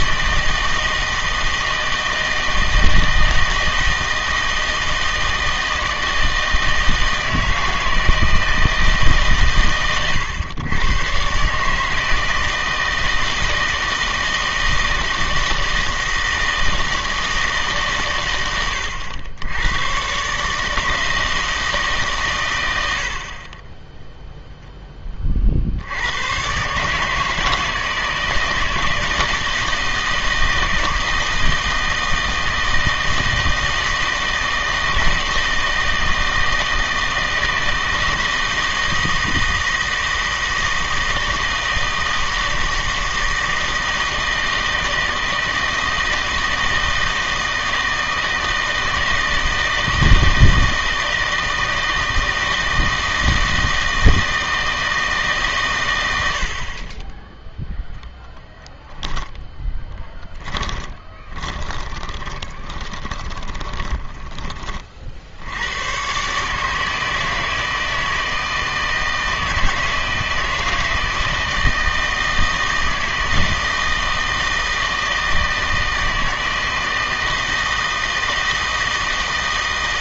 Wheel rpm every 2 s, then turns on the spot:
160, 160, 160, 160, 160, 120, 160, 160, 160, 100, 150, 100, 10, 140, 160, 160, 160, 160, 160, 160, 160, 160, 160, 160, 160, 160, 160, 160, 40, 10, 20, 20, 30, 150, 160, 160, 160, 160, 160, 160.
58-64